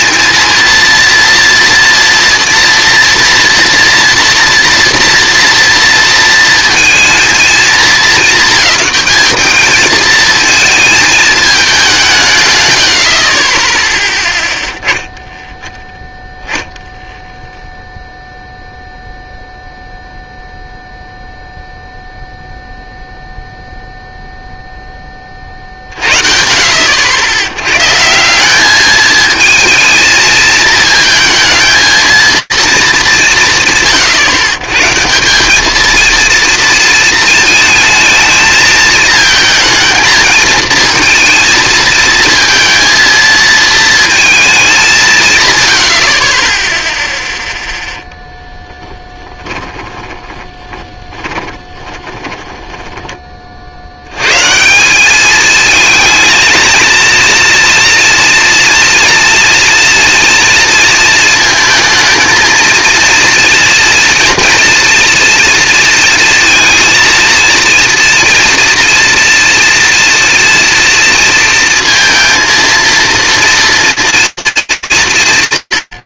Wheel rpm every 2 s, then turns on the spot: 230, 230, 230, 220, 220, 220, 90, 10, 0, 0, 0, 0, 10, 70, 220, 220, 230, 140, 230, 220, 230, 230, 200, 0, 10, 20, 30, 210, 230, 240, 230, 230, 230, 230, 230, 230, 240, 170.
48-52